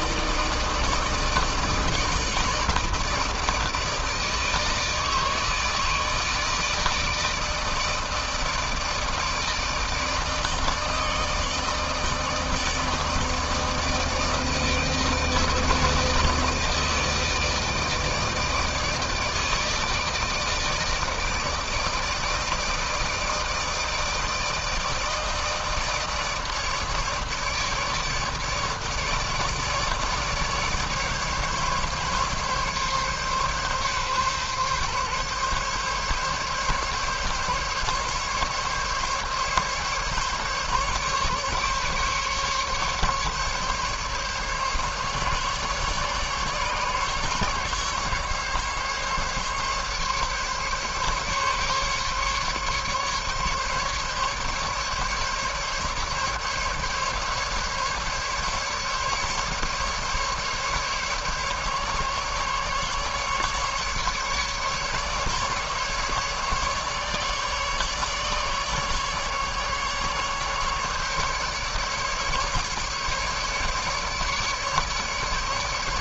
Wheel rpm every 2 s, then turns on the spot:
160, 160, 150, 160, 160, 150, 160, 160, 160, 160, 160, 160, 160, 150, 150, 150, 140, 140, 140, 140, 140, 140, 140, 140, 140, 140, 140, 140, 140, 150, 150, 140, 140, 150, 150, 150, 150, 150.
none